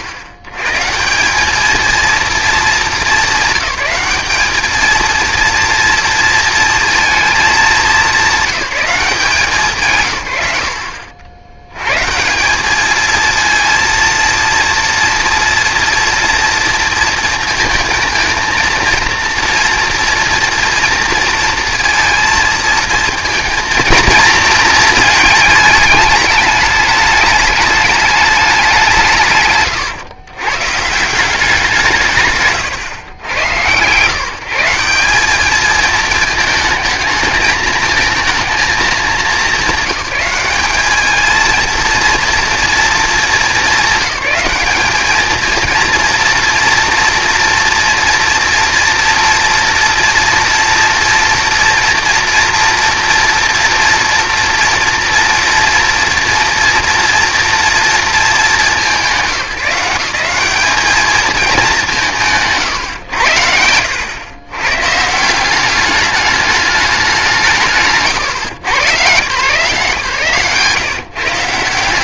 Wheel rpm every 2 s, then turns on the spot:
120, 210, 220, 230, 180, 70, 190, 230, 230, 230, 230, 230, 230, 210, 180, 130, 140, 160, 220, 210, 210, 230, 200, 240, 240, 240, 230, 240, 230, 200, 210, 130, 140, 200, 100, 140.
70-72